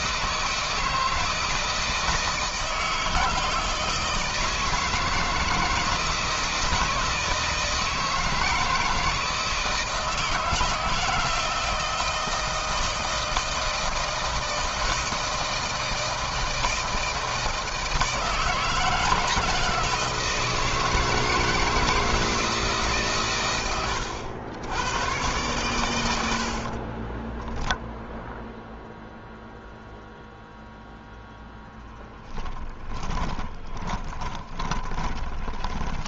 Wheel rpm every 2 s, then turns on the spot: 160, 160, 160, 160, 160, 160, 160, 160, 160, 160, 160, 140, 100, 20, 0, 0, 20, 20.
26-28 32-36